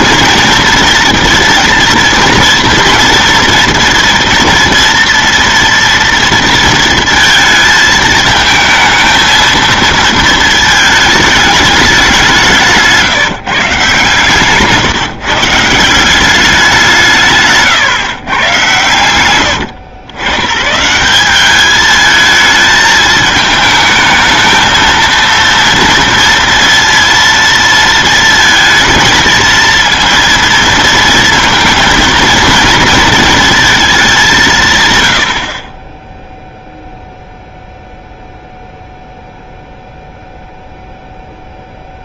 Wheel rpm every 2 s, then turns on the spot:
230, 230, 230, 230, 220, 220, 170, 140, 190, 110, 80, 220, 220, 230, 230, 230, 230, 160, 0, 0, 0.
14-16